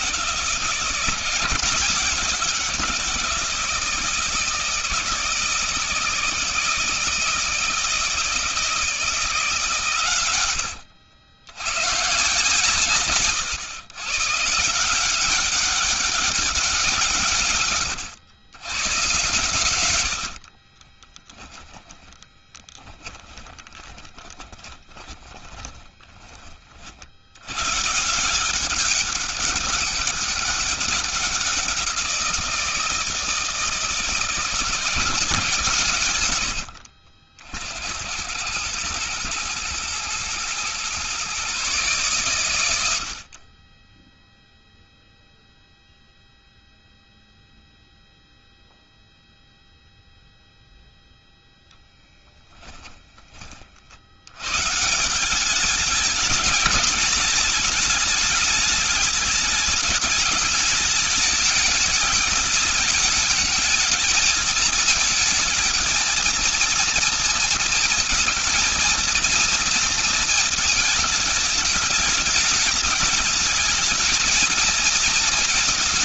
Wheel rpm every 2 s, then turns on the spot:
170, 170, 160, 160, 160, 100, 140, 160, 170, 110, 40, 10, 20, 50, 190, 190, 170, 170, 80, 100, 120, 90, 0, 0, 0, 0, 10, 160, 210, 210, 210, 210, 220, 230, 230, 220, 210, 220.
20-26